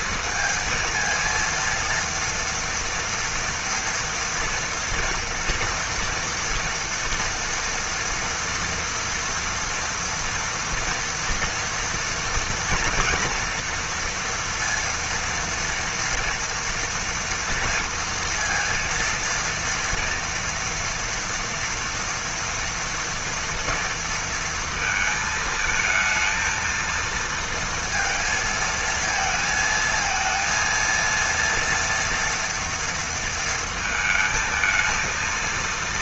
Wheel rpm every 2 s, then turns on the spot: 230, 230, 230, 230, 230, 230, 230, 230, 230, 230, 230, 240, 230, 230, 220, 230, 230, 220.
none